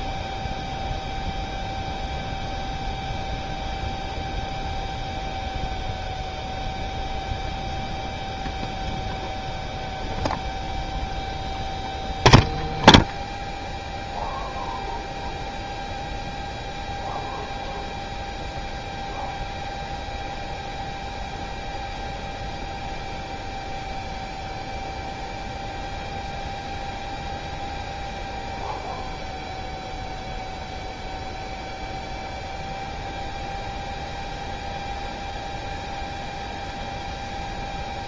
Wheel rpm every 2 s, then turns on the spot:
0, 0, 0, 0, 0, 0, 0, 0, 0, 0, 0, 0, 0, 0, 0, 0, 0, 0, 0.
none